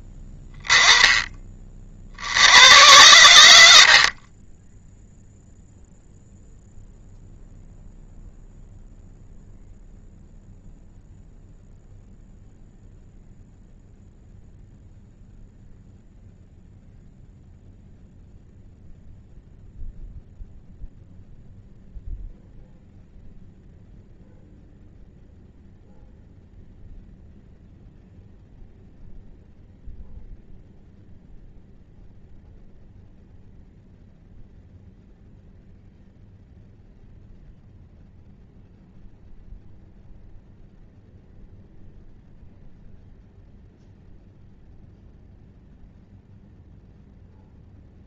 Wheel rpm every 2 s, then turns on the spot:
10, 90, 10, 0, 0, 0, 0, 0, 0, 0, 0, 0, 0, 0, 0, 0, 0, 0, 0, 0, 0, 0, 0, 0.
none